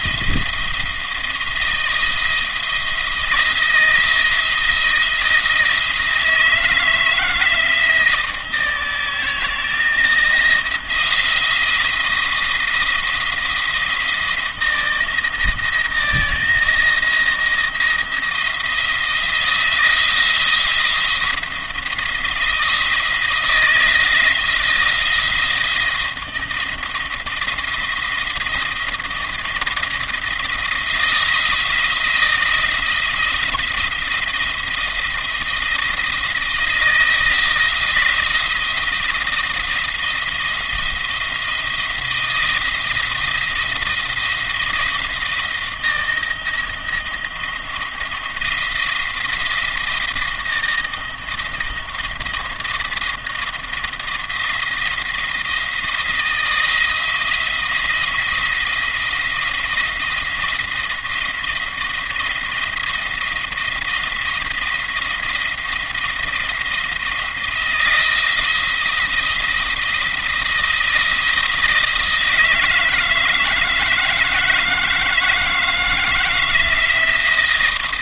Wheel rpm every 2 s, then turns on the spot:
160, 160, 170, 160, 160, 170, 170, 170, 170, 170, 170, 170, 170, 170, 170, 160, 160, 170, 160, 160, 170, 170, 170, 170, 170, 170, 170, 160, 160, 170, 170, 170, 160, 170, 170, 170, 160, 160, 160.
none